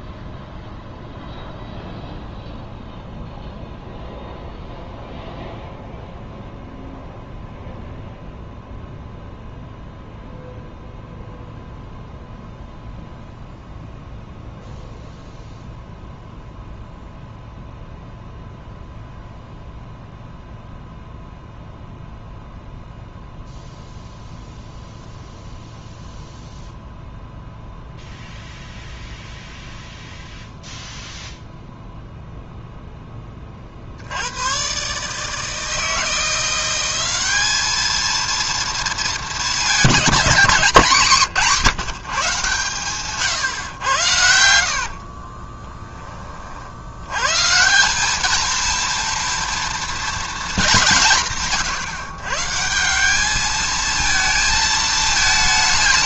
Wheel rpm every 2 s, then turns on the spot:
0, 0, 0, 0, 0, 0, 0, 0, 0, 0, 0, 0, 0, 0, 0, 0, 0, 130, 190, 230, 200, 140, 70, 70, 230, 200, 160, 220.
44-46